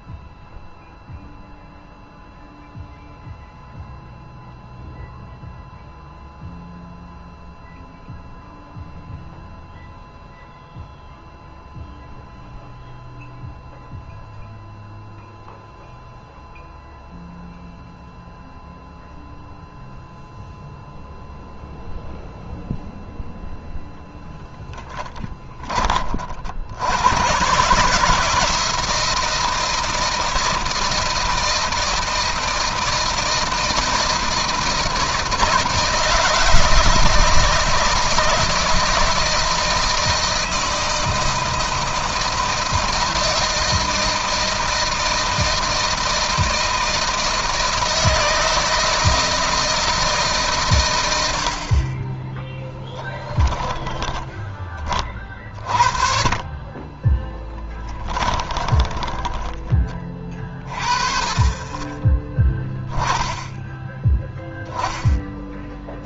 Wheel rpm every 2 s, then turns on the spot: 0, 0, 0, 0, 0, 0, 0, 0, 0, 0, 0, 0, 10, 90, 160, 160, 160, 160, 160, 160, 160, 160, 160, 160, 160, 110, 10, 30, 20, 10, 30, 10, 10.
24-26 52-54 56-60